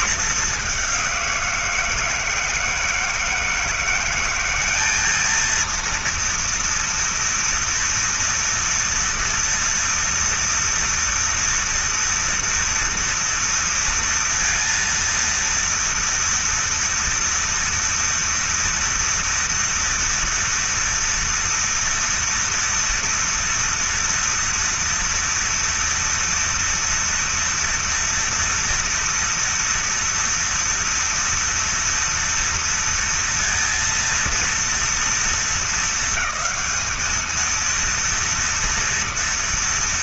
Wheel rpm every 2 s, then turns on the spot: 210, 160, 200, 230, 230, 230, 230, 230, 230, 230, 240, 230, 240, 240, 240, 230, 240, 230, 220, 230.
none